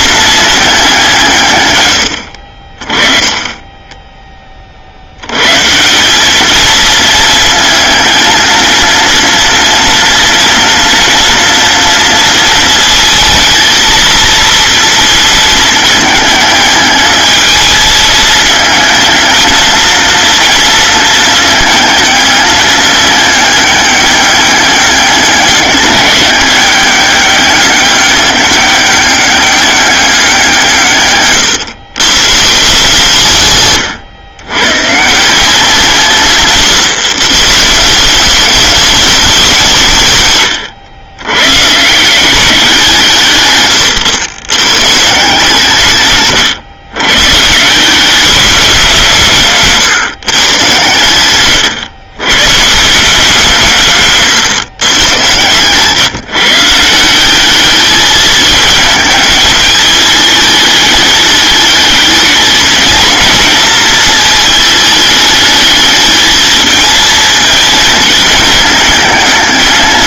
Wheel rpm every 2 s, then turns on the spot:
170, 30, 90, 230, 230, 230, 220, 230, 220, 230, 220, 210, 200, 200, 200, 140, 150, 160, 140, 200, 100, 150, 140, 140, 160, 110, 170, 110, 180, 220, 210, 230, 210, 230, 220.
30-32 50-52